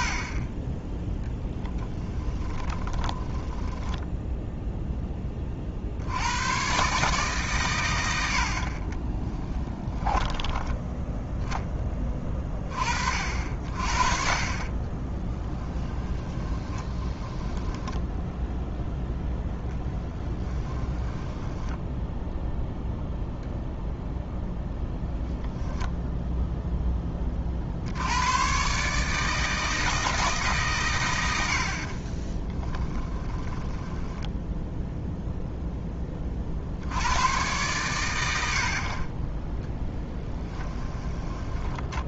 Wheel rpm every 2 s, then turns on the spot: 10, 20, 0, 130, 40, 10, 40, 40, 20, 0, 10, 0, 0, 10, 140, 130, 10, 0, 70, 60, 20.
2-4 14-18 20-22 32-34 40-42